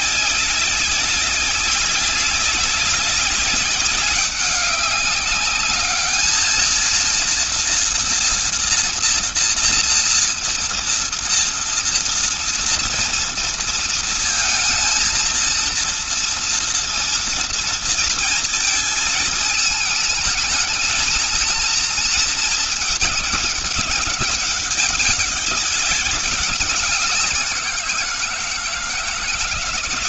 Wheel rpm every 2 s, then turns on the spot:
200, 200, 200, 220, 230, 230, 230, 230, 230, 230, 220, 220, 200, 190, 160.
none